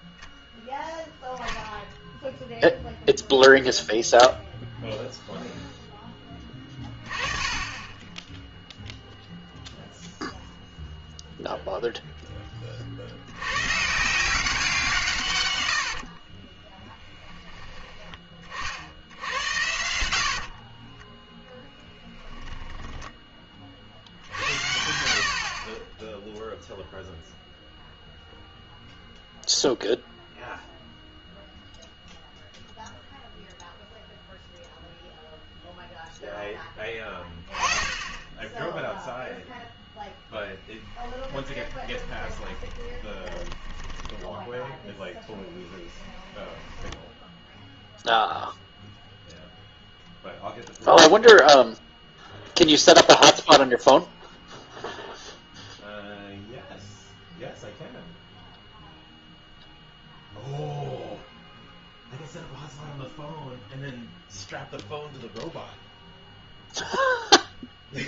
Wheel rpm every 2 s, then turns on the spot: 0, 0, 0, 30, 0, 0, 30, 180, 20, 50, 30, 10, 70, 0, 0, 0, 0, 0, 10, 0, 10, 20, 10, 10, 0, 0, 0, 0, 0, 0, 0, 0, 0, 0.
16-18 20-24 40-44 46-48